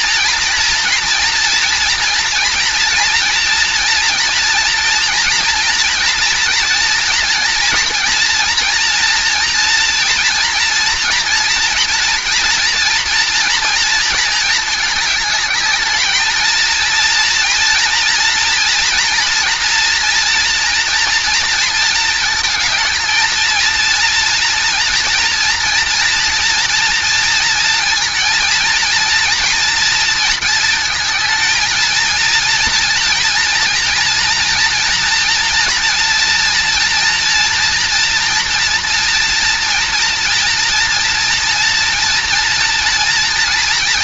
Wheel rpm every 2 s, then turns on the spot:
230, 230, 230, 240, 230, 240, 230, 210, 230, 230, 230, 220, 230, 230, 230, 220, 230, 230, 230, 240, 230, 230.
none